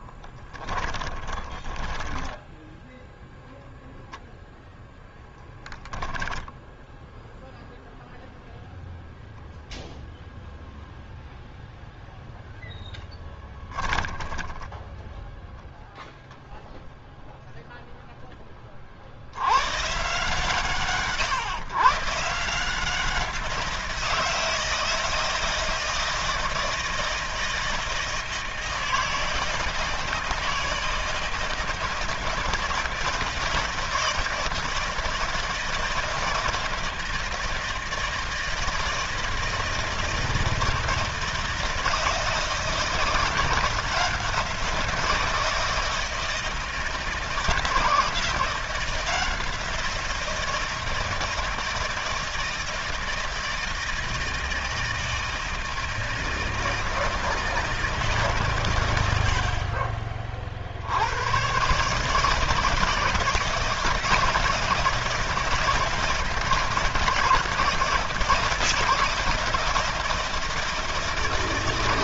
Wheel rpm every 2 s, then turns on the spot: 10, 0, 0, 0, 0, 0, 10, 10, 0, 30, 140, 170, 160, 160, 160, 160, 160, 160, 160, 160, 160, 160, 170, 160, 170, 170, 160, 160, 160, 130, 50, 160, 160, 170, 160, 160.
0-2 12-16